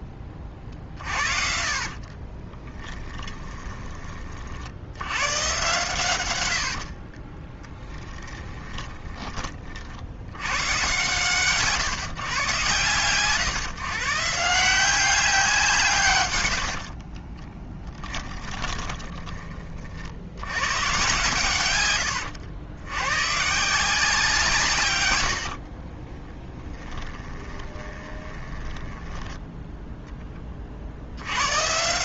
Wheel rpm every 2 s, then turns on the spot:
30, 20, 90, 60, 20, 120, 130, 180, 60, 20, 120, 100, 130, 10, 10, 50.
0-4 6-10 16-20 26-30